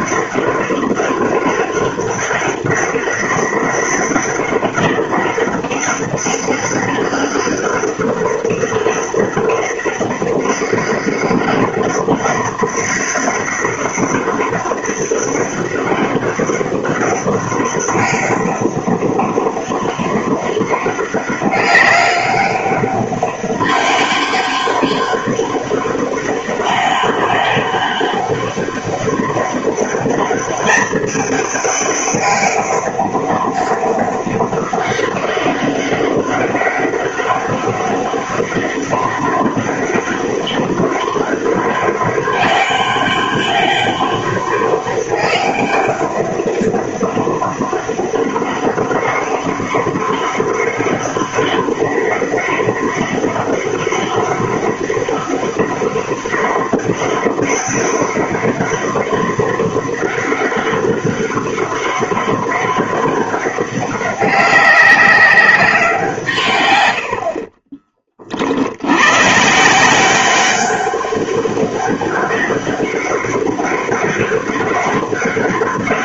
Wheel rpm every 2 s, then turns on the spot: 200, 200, 200, 200, 200, 200, 200, 200, 200, 200, 200, 200, 200, 200, 200, 210, 200, 200, 200, 200, 200, 200, 200, 200, 200, 200, 200, 200, 200, 200, 200, 200, 200, 130, 60, 190, 200, 200.
none